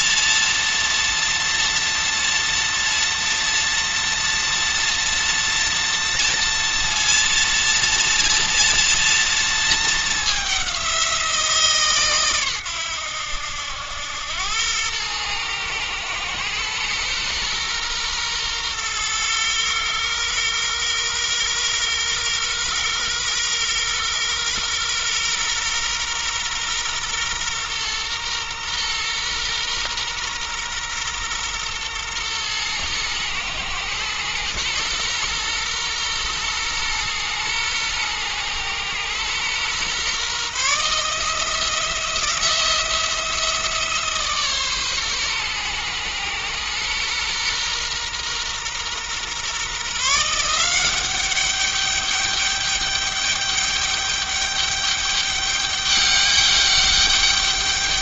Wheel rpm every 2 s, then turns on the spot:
230, 230, 230, 230, 230, 190, 110, 100, 120, 120, 120, 120, 120, 120, 120, 120, 110, 120, 120, 120, 150, 170, 140, 120, 120, 180, 200, 200, 200.
none